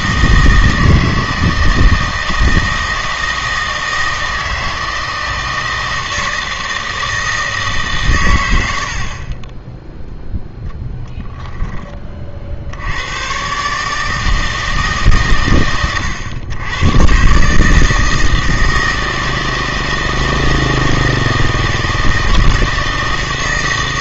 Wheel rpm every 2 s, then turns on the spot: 160, 160, 160, 160, 80, 0, 70, 150, 110, 160, 160, 160.
none